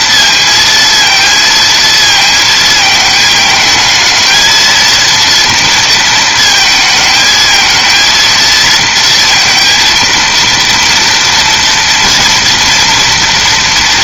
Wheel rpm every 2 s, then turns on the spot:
230, 220, 230, 220, 230, 230, 230.
none